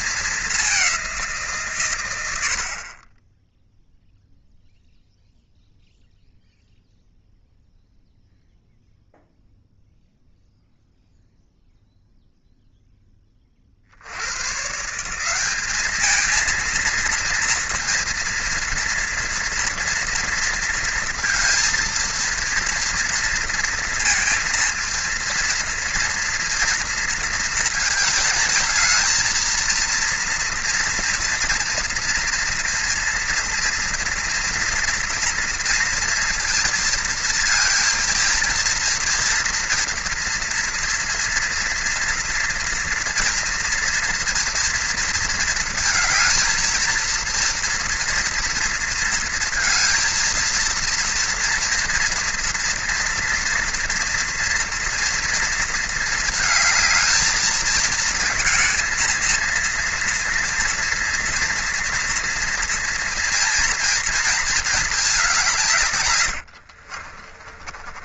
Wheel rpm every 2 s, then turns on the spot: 200, 50, 0, 0, 0, 0, 0, 130, 230, 230, 230, 230, 230, 230, 230, 230, 230, 230, 230, 230, 230, 240, 230, 230, 230, 230, 230, 240, 220, 220, 240, 230, 220, 70.
66-68